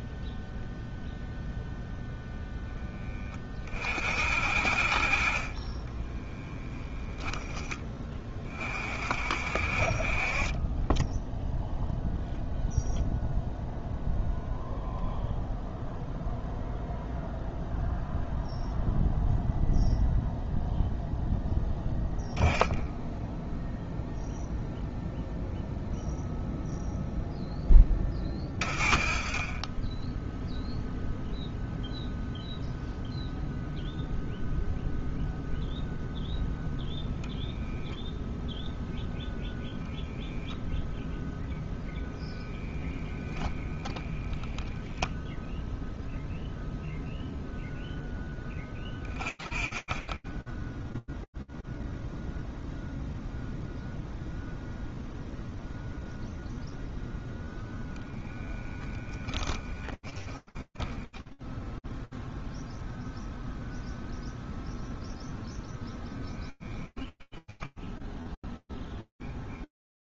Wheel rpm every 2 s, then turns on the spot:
0, 10, 40, 0, 40, 30, 0, 0, 0, 0, 0, 10, 0, 0, 30, 0, 0, 0, 0, 0, 0, 0, 0, 0, 20, 0, 0, 0, 0, 10, 0, 0, 0, 10, 0.
58-60 66-68